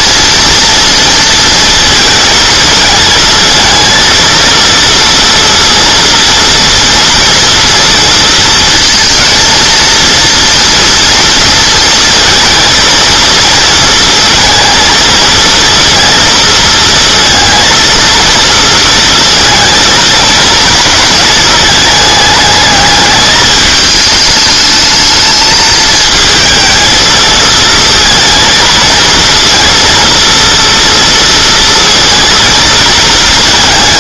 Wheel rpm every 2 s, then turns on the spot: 230, 220, 230, 230, 230, 230, 230, 230, 230, 230, 230, 210, 220, 220, 230, 230, 230.
none